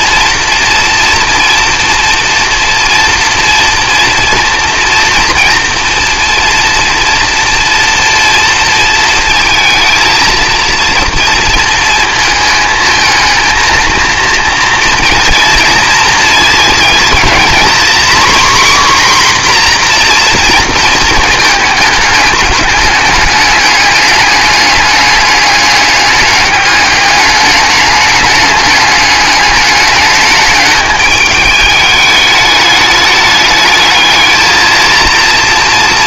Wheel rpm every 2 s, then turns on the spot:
230, 230, 230, 230, 230, 230, 220, 230, 230, 260, 240, 210, 210, 200, 210, 210, 210, 220.
none